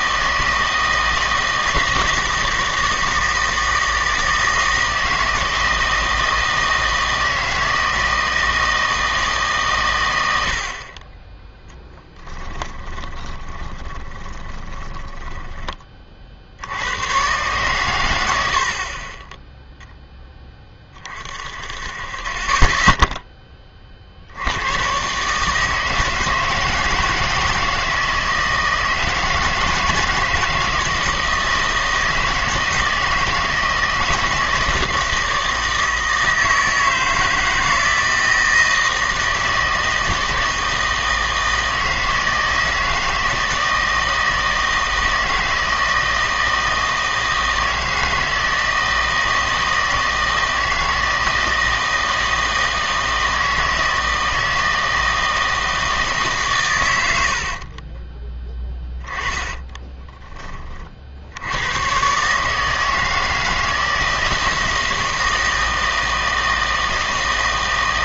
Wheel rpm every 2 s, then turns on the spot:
160, 160, 160, 160, 160, 30, 10, 20, 100, 40, 30, 10, 130, 160, 160, 160, 160, 160, 160, 160, 160, 160, 160, 160, 160, 160, 160, 160, 110, 10, 40, 160, 160, 160.
12-16 58-60